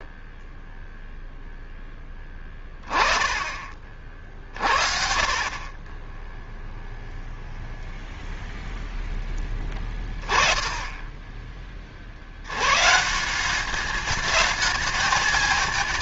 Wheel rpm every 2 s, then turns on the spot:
0, 10, 50, 0, 10, 20, 140, 220.
none